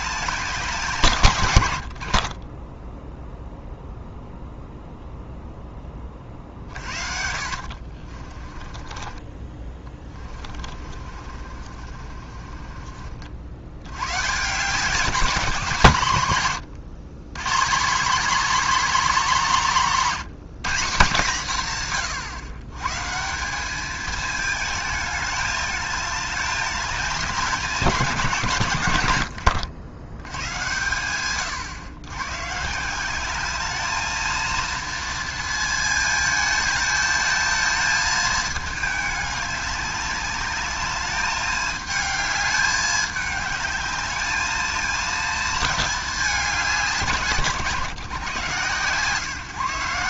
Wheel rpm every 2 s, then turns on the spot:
180, 20, 0, 40, 30, 40, 40, 160, 130, 260, 190, 130, 210, 200, 130, 110, 150, 230, 220, 220, 210, 210, 220, 170, 140.
2-4 6-14